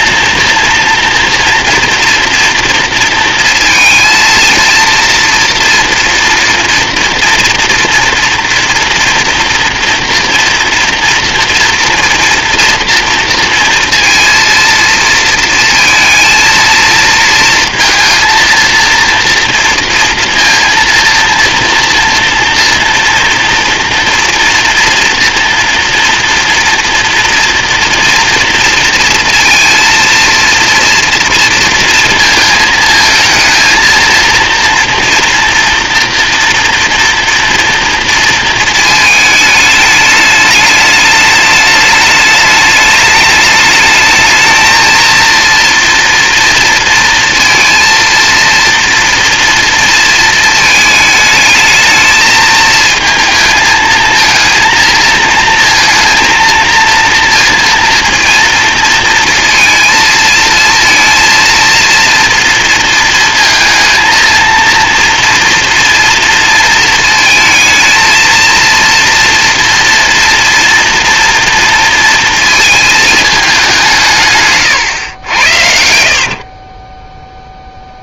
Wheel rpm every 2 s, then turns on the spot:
230, 230, 230, 230, 230, 240, 240, 230, 230, 230, 230, 230, 230, 240, 230, 230, 220, 230, 230, 220, 210, 210, 220, 230, 230, 220, 220, 230, 230, 230, 230, 230, 230, 230, 230, 230, 220, 130, 40.
76-78